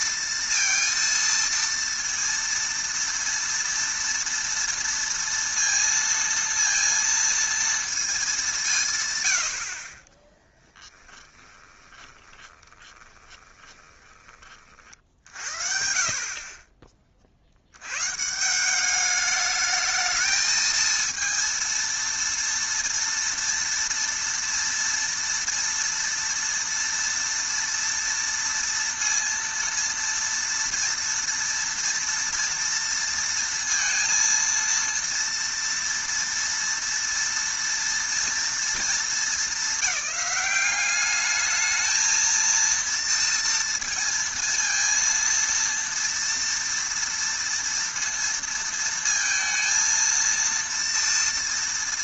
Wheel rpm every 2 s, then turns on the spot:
230, 230, 230, 230, 150, 10, 20, 40, 30, 190, 220, 230, 230, 230, 230, 230, 230, 230, 230, 230, 200, 230, 230, 230, 230, 230.
10-14